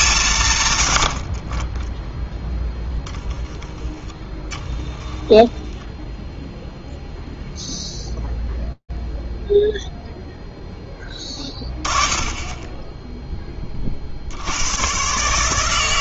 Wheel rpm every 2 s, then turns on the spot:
120, 10, 10, 0, 0, 10, 10, 110.
4-6